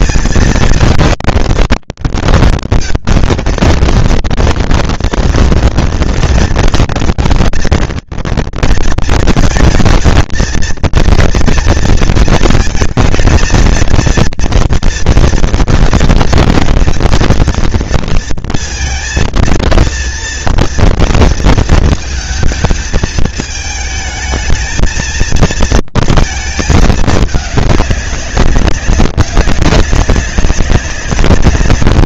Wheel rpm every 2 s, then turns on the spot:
230, 230, 230, 230, 230, 230, 220, 230, 230, 230, 230, 220, 220, 230, 190, 190.
none